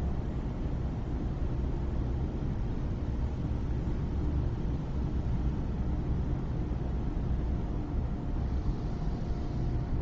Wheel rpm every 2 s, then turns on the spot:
0, 0, 0, 0, 0.
none